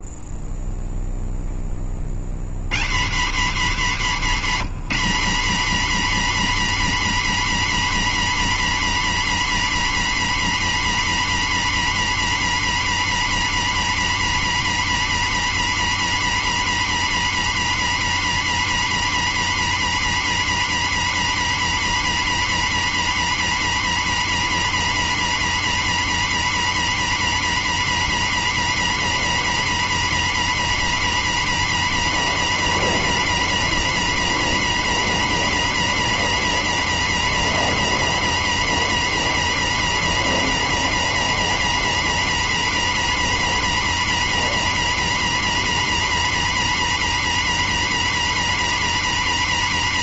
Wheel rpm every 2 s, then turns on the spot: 0, 100, 120, 130, 130, 130, 130, 130, 130, 130, 130, 130, 130, 130, 130, 130, 130, 130, 130, 130, 130, 130, 130, 130, 130.
none